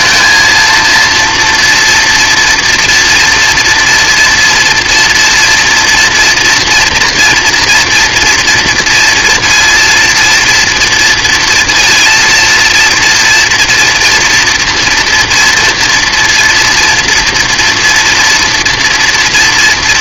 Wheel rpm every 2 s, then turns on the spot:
230, 230, 240, 230, 230, 230, 230, 230, 230, 230.
none